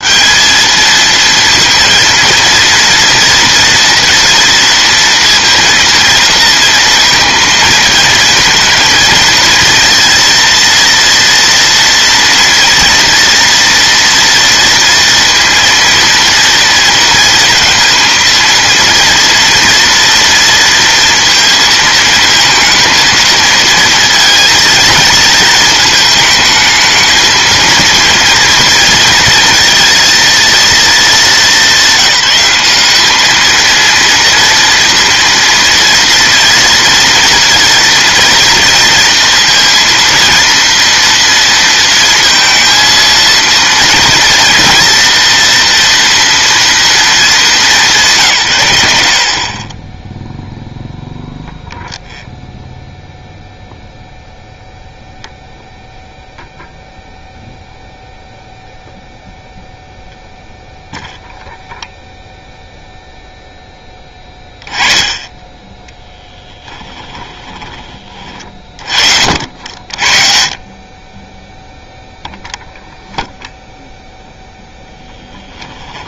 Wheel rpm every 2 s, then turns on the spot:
220, 230, 230, 230, 230, 230, 230, 230, 230, 230, 230, 230, 230, 220, 230, 220, 200, 230, 240, 230, 230, 230, 230, 230, 110, 0, 0, 0, 0, 0, 0, 0, 20, 10, 30, 30, 0, 0.
66-68